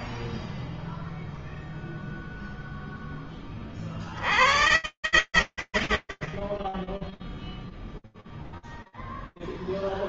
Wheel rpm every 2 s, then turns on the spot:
10, 0, 20, 20, 0.
none